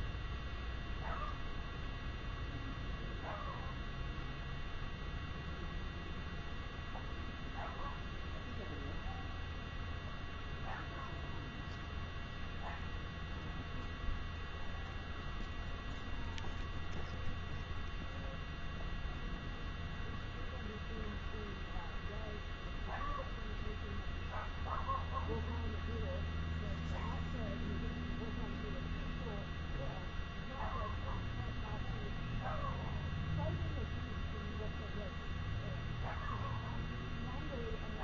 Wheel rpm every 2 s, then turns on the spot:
0, 0, 0, 0, 0, 0, 0, 0, 0, 0, 0, 0, 0, 0, 0, 0, 0, 0, 0.
none